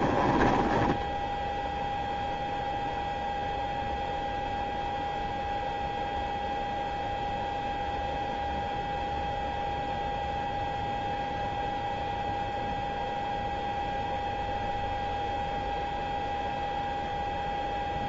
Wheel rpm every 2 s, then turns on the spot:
20, 0, 0, 0, 0, 0, 0, 0, 0.
0-2